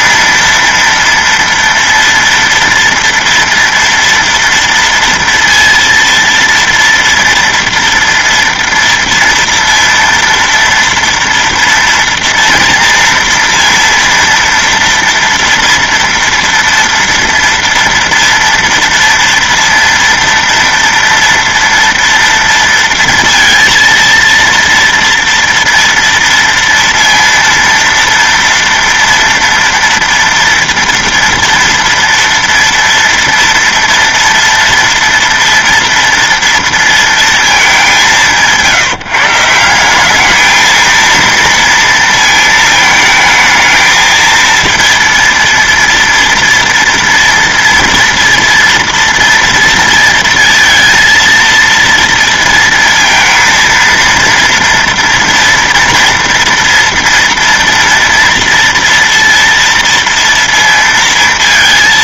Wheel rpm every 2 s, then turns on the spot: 230, 230, 230, 230, 230, 230, 230, 230, 230, 230, 230, 230, 230, 230, 240, 230, 230, 230, 230, 160, 220, 220, 230, 230, 230, 230, 230, 230, 230, 230, 230.
none